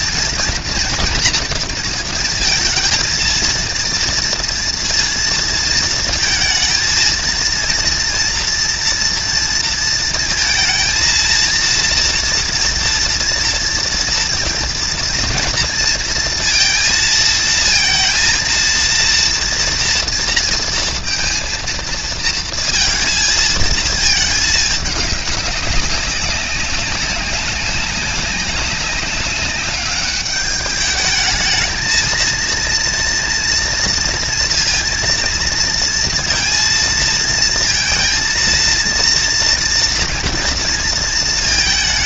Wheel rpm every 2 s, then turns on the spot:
240, 230, 230, 230, 230, 230, 230, 230, 230, 230, 230, 230, 210, 200, 200, 210, 230, 230, 230, 230, 230.
none